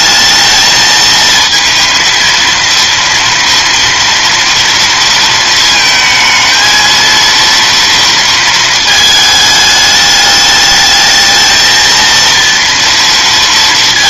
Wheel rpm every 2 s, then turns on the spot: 220, 230, 230, 230, 220, 210, 230.
none